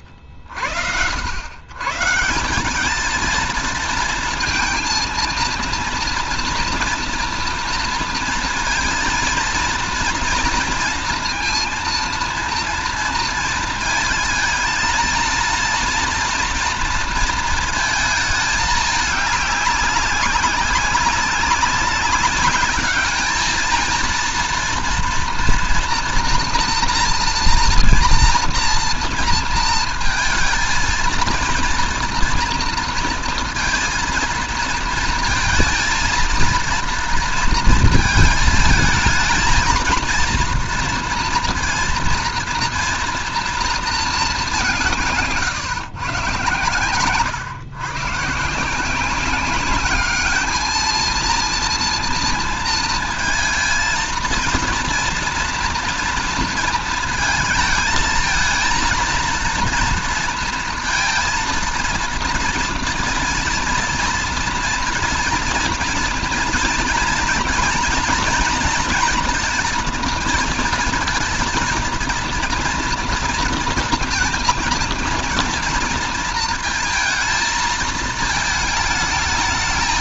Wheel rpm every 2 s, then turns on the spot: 70, 180, 230, 230, 230, 230, 230, 220, 230, 210, 190, 200, 230, 240, 230, 220, 230, 230, 230, 220, 230, 230, 200, 120, 150, 220, 230, 230, 230, 230, 230, 230, 230, 230, 230, 230, 230, 230, 230, 220.
none